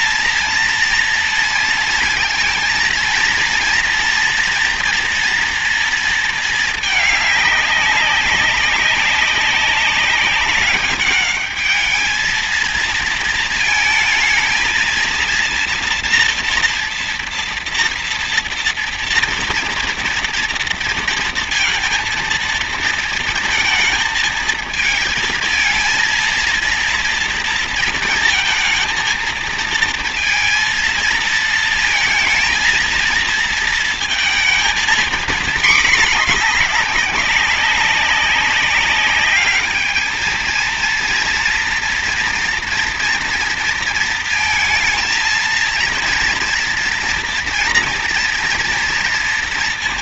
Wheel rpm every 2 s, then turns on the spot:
230, 230, 240, 220, 200, 200, 220, 230, 240, 230, 230, 230, 220, 230, 230, 230, 230, 230, 210, 200, 220, 240, 230, 230, 230.
none